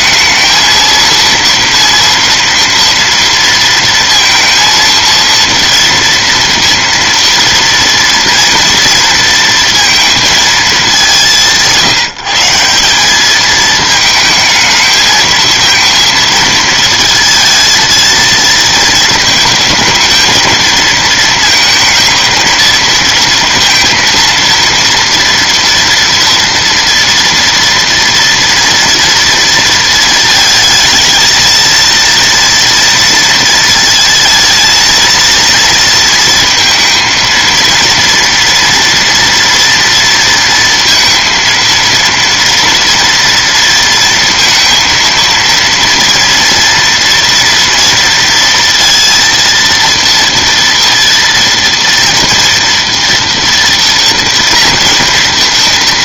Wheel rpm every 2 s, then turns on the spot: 230, 230, 230, 230, 230, 200, 170, 220, 220, 220, 220, 230, 230, 240, 230, 220, 230, 230, 230, 230, 230, 230, 230, 230, 230, 230, 230, 230.
none